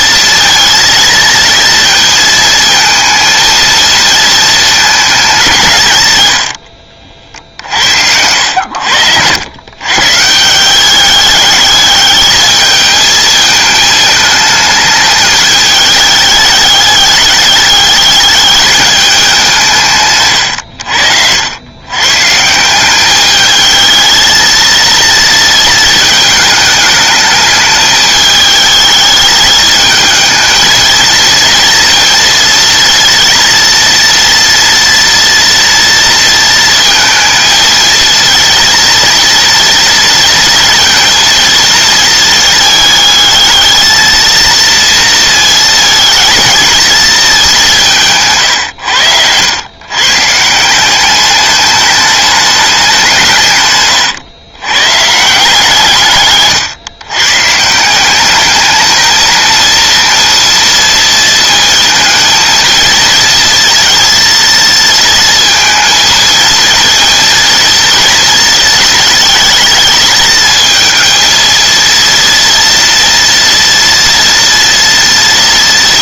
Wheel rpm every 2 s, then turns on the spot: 230, 230, 220, 70, 80, 180, 220, 220, 210, 210, 90, 180, 230, 220, 210, 220, 230, 230, 230, 230, 230, 220, 230, 220, 110, 180, 200, 130, 130, 220, 230, 230, 230, 230, 220, 220, 230, 230.
8-10 48-50